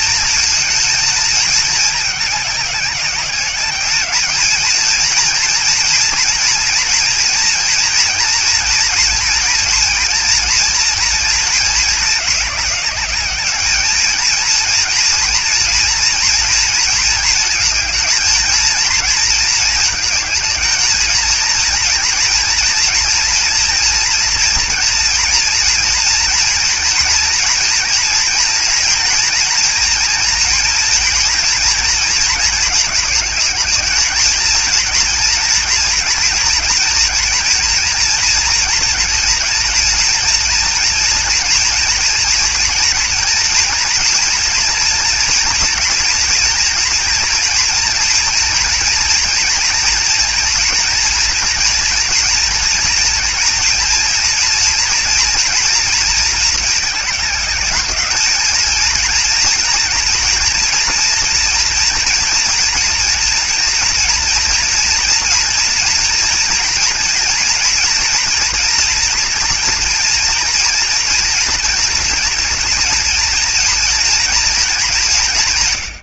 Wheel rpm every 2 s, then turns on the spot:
230, 190, 230, 240, 230, 230, 200, 230, 230, 230, 220, 240, 230, 230, 230, 230, 220, 240, 230, 230, 230, 240, 230, 230, 230, 240, 230, 230, 220, 230, 230, 230, 240, 230, 230, 230, 230, 190.
none